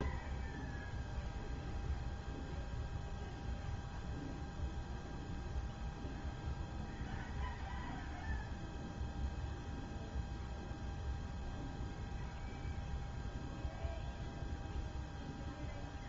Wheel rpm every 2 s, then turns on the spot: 0, 0, 0, 0, 0, 0, 0, 0.
none